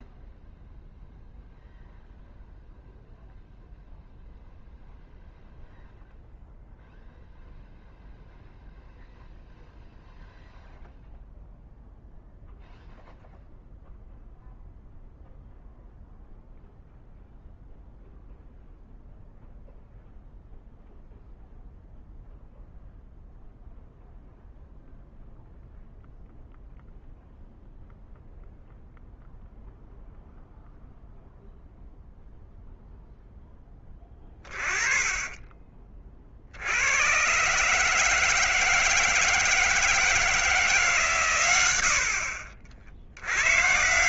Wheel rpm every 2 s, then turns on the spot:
0, 0, 0, 0, 0, 0, 0, 0, 0, 0, 0, 0, 0, 0, 0, 0, 0, 10, 70, 160, 160, 70.
none